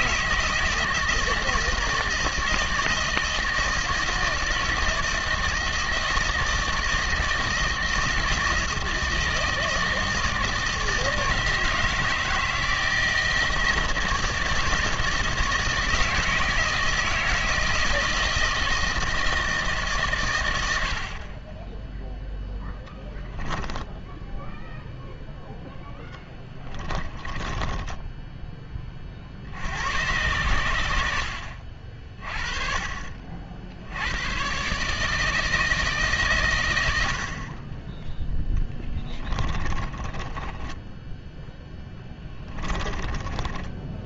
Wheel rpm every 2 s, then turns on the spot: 160, 160, 160, 160, 160, 160, 160, 160, 160, 160, 90, 10, 0, 20, 20, 90, 40, 130, 110, 10, 20, 20.
22-24 26-28 38-44